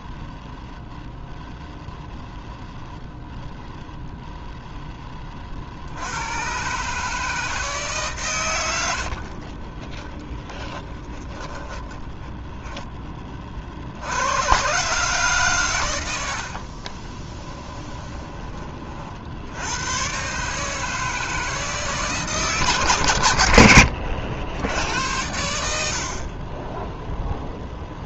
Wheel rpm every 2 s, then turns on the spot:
0, 0, 10, 140, 90, 10, 10, 130, 40, 30, 150, 140, 90, 10.
10-12 16-18